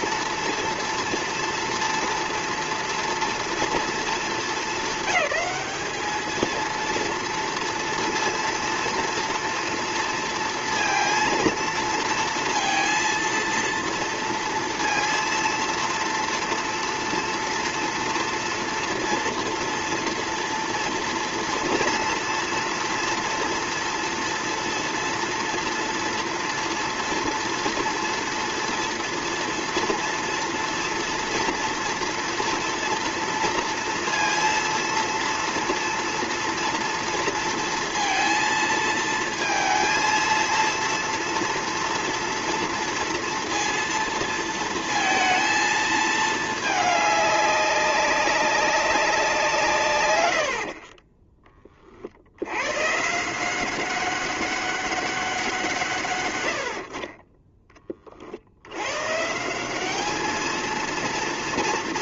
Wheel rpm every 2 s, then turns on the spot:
230, 230, 200, 230, 230, 230, 230, 230, 230, 230, 230, 230, 230, 230, 230, 230, 230, 230, 230, 230, 230, 230, 230, 210, 200, 60, 110, 200, 80, 80, 220.
none